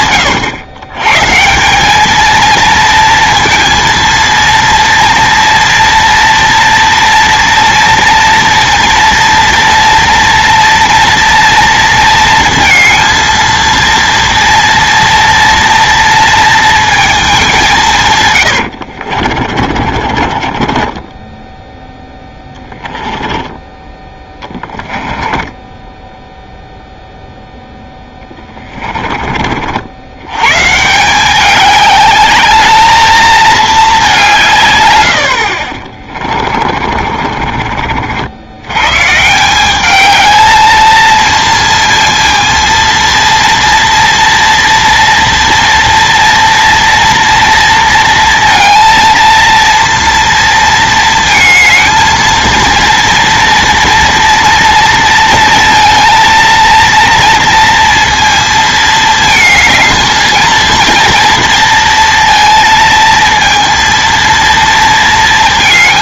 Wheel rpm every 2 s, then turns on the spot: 120, 230, 230, 230, 230, 230, 230, 230, 230, 90, 20, 10, 20, 0, 20, 140, 220, 130, 30, 100, 220, 230, 230, 230, 230, 230, 230, 230, 230, 220, 230, 230, 230.
18-26 28-30 36-38